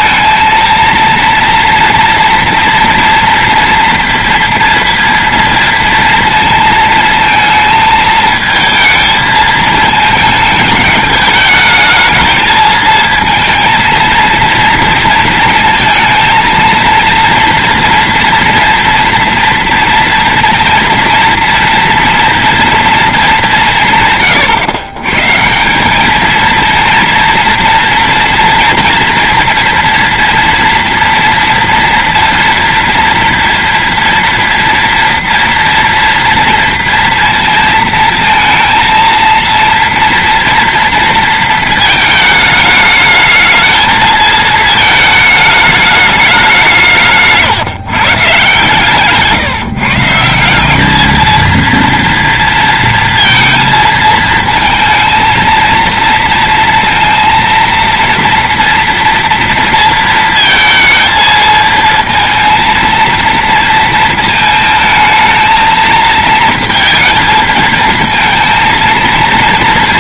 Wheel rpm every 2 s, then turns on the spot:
230, 230, 230, 230, 220, 220, 230, 230, 230, 230, 230, 230, 130, 230, 230, 230, 230, 230, 230, 230, 230, 220, 220, 180, 140, 190, 230, 220, 230, 230, 230, 230, 220, 230, 230.
none